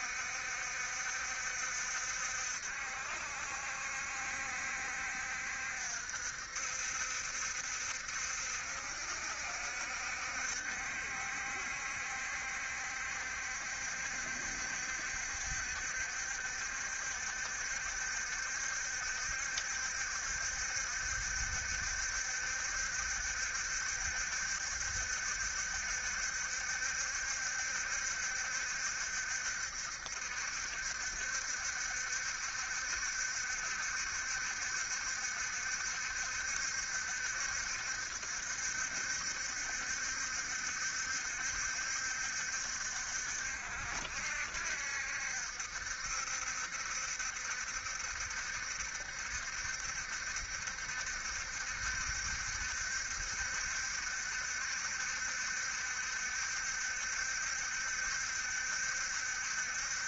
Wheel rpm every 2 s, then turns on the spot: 70, 60, 70, 70, 70, 70, 70, 70, 70, 70, 70, 70, 70, 70, 70, 60, 70, 70, 70, 70, 70, 60, 70, 70, 70, 70, 70, 70, 70, 70.
none